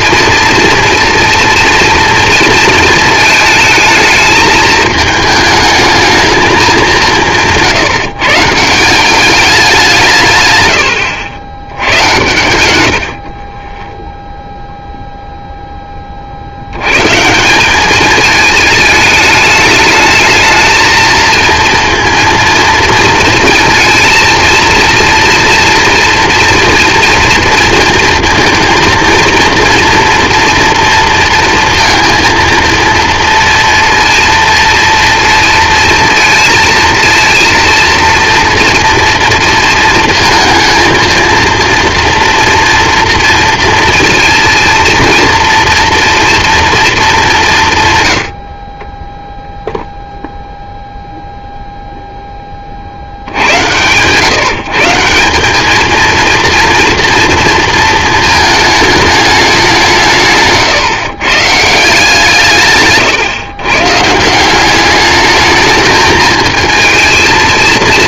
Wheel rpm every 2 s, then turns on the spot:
230, 230, 210, 210, 160, 120, 90, 0, 100, 220, 220, 230, 230, 230, 230, 230, 230, 230, 230, 230, 220, 230, 230, 230, 40, 0, 20, 160, 230, 220, 150, 150, 180, 220.
none